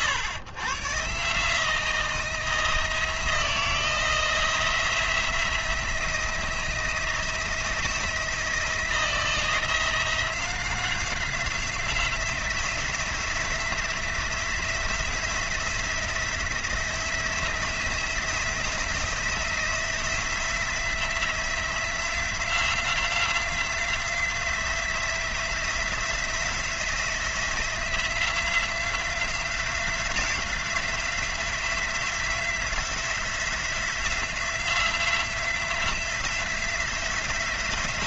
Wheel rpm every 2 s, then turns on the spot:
120, 170, 170, 170, 170, 180, 180, 180, 170, 170, 170, 180, 180, 170, 180, 180, 180, 170, 180.
none